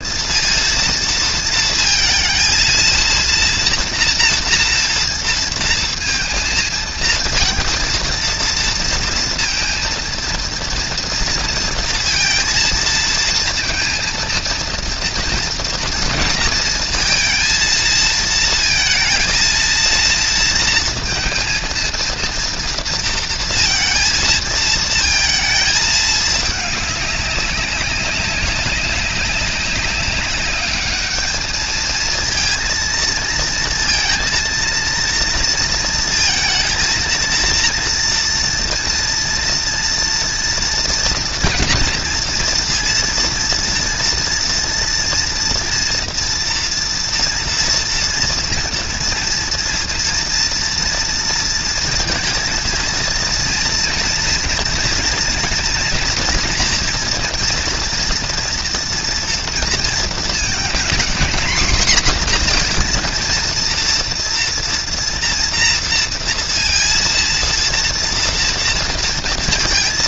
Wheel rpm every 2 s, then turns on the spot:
230, 230, 230, 230, 230, 230, 230, 230, 230, 230, 230, 230, 220, 210, 200, 210, 230, 230, 230, 230, 230, 230, 230, 230, 230, 230, 230, 230, 240, 230, 230, 240, 230, 230, 230.
none